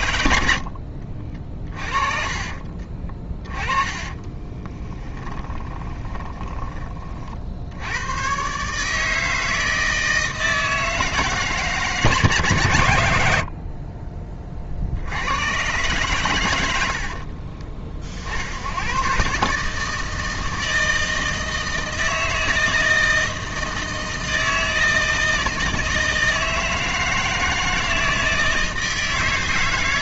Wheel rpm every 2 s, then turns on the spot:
70, 30, 20, 20, 150, 160, 130, 40, 110, 80, 160, 160, 160, 160, 160.
0-6